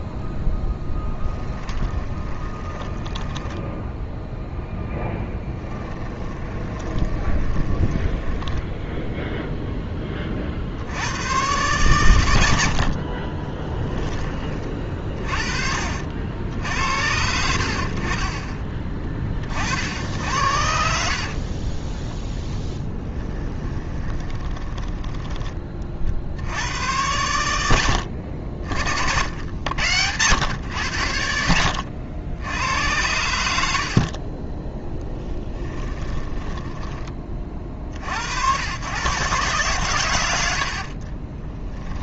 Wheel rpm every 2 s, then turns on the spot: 10, 20, 10, 20, 10, 70, 60, 40, 70, 20, 80, 10, 10, 80, 70, 110, 90, 10, 10, 110, 50.
2-4 6-10 12-14 22-26 40-42